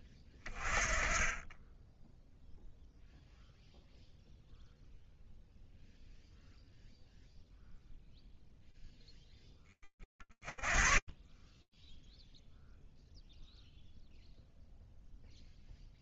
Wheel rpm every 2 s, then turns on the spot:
20, 0, 0, 0, 30, 0, 0, 0.
none